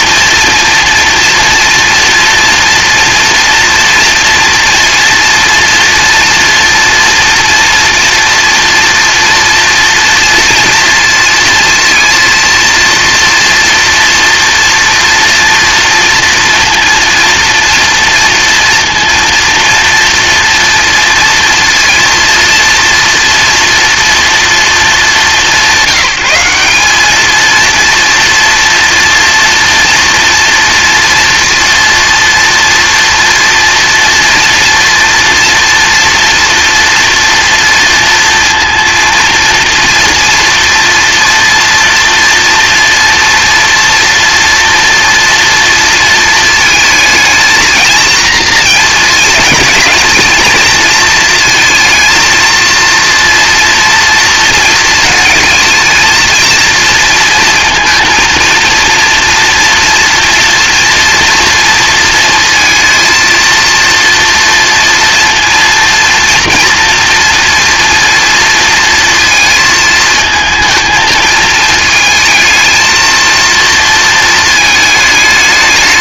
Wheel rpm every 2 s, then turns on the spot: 240, 230, 230, 240, 230, 230, 230, 230, 230, 230, 230, 230, 230, 200, 230, 230, 230, 230, 230, 230, 230, 230, 230, 220, 230, 220, 230, 220, 230, 230, 230, 230, 230, 240, 230, 220, 220, 220.
none